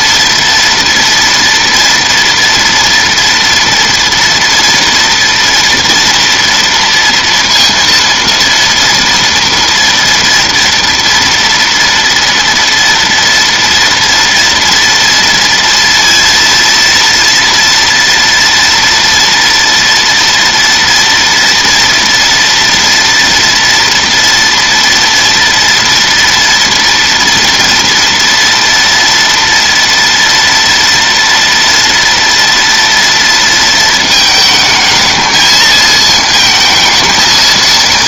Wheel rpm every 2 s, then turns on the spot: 230, 230, 230, 230, 230, 230, 240, 240, 230, 230, 230, 230, 230, 230, 230, 230, 230, 220, 220.
none